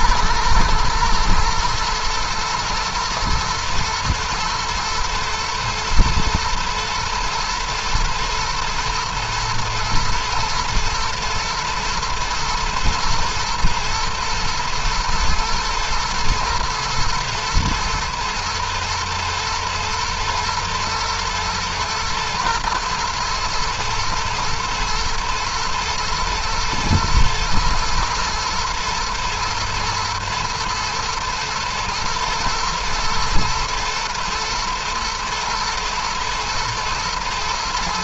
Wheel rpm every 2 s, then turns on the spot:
120, 120, 110, 110, 110, 110, 110, 120, 110, 120, 110, 110, 120, 110, 110, 120, 120, 110, 110.
none